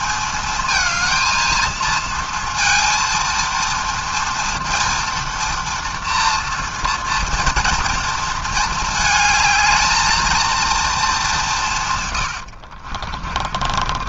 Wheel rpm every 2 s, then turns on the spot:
220, 230, 230, 230, 220, 220, 70.
12-14